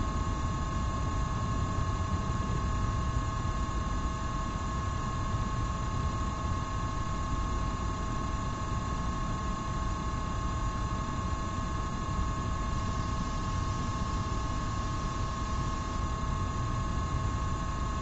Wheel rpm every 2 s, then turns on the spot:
0, 0, 0, 0, 0, 0, 0, 0, 0.
none